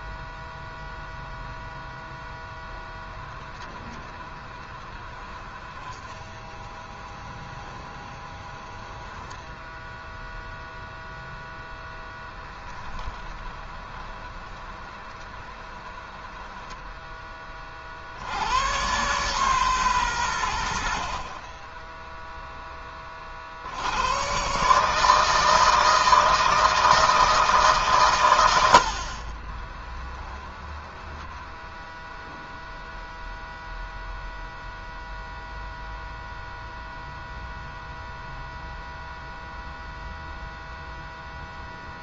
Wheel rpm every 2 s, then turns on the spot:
0, 0, 20, 20, 20, 0, 20, 20, 10, 110, 90, 10, 140, 160, 90, 10, 0, 0, 0, 0, 0.
4-10 12-18 30-32